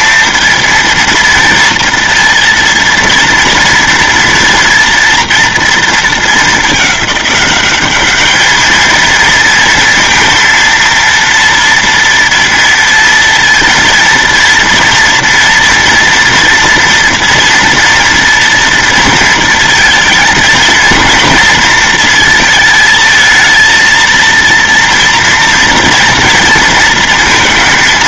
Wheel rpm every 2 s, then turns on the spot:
230, 230, 230, 200, 220, 230, 230, 230, 240, 230, 230, 220, 230, 230.
none